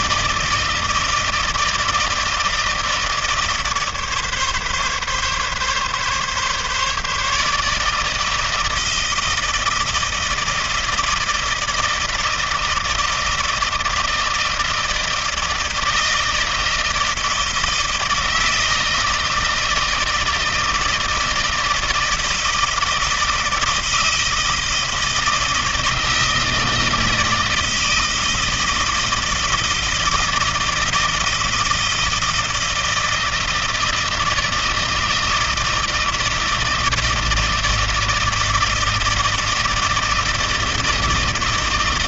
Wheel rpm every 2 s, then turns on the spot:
160, 160, 140, 140, 160, 160, 160, 160, 160, 160, 160, 160, 160, 160, 160, 160, 160, 160, 160, 160, 160.
none